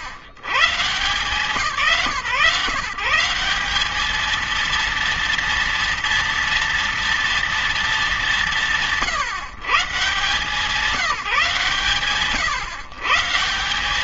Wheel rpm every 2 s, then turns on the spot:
110, 170, 230, 230, 170, 170, 140.
none